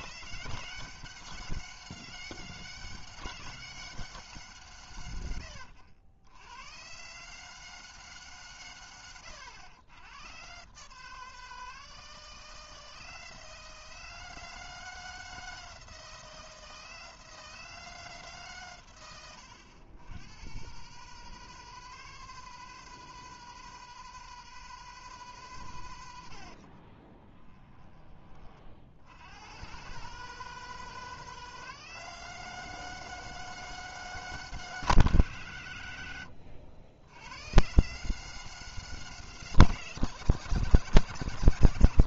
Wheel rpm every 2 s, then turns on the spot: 160, 160, 110, 130, 110, 150, 160, 160, 160, 120, 140, 160, 160, 30, 70, 160, 160, 160, 90, 160, 140.
8-10 26-28